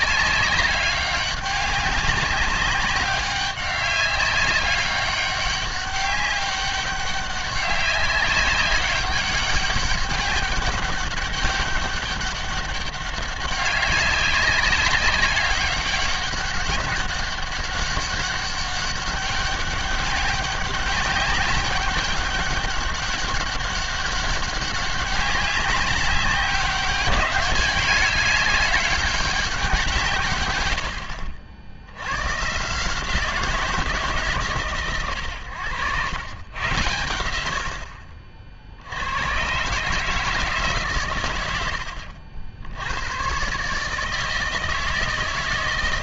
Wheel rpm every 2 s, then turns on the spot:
190, 190, 200, 200, 200, 200, 200, 190, 200, 200, 200, 200, 190, 200, 200, 150, 140, 130, 110, 70, 150, 80, 160.
none